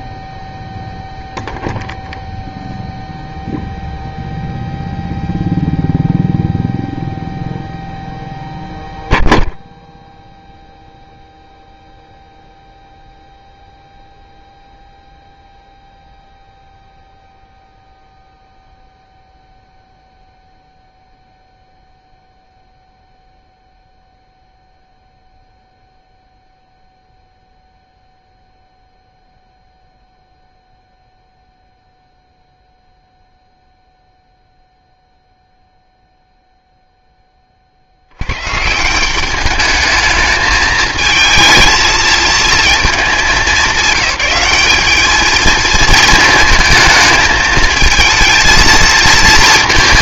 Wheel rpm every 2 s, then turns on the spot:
0, 0, 0, 0, 0, 0, 0, 0, 0, 0, 0, 0, 0, 0, 0, 0, 0, 0, 0, 150, 220, 220, 210, 220, 230.
none